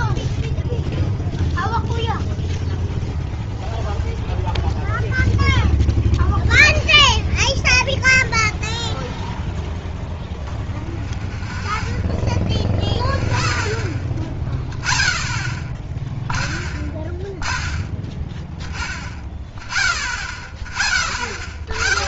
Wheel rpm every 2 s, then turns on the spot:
0, 0, 0, 0, 0, 0, 0, 0, 0, 0, 0.
none